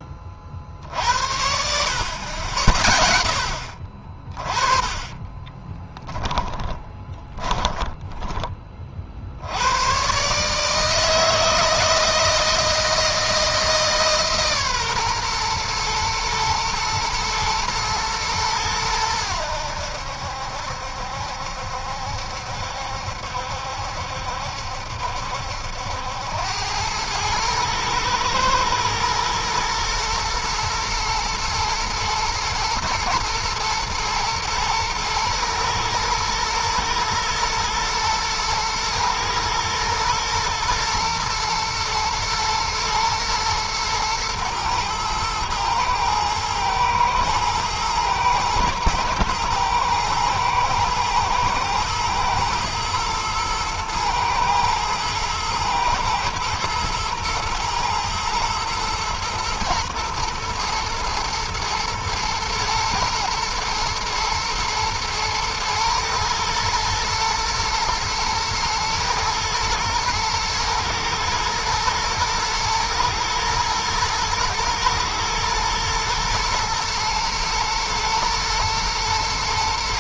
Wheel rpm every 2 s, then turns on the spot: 50, 70, 30, 10, 30, 150, 160, 140, 120, 110, 70, 70, 70, 100, 110, 120, 110, 120, 120, 110, 110, 120, 110, 110, 110, 110, 110, 110, 120, 110, 120, 110, 110, 110, 110, 110, 120, 110, 110, 120.
4-8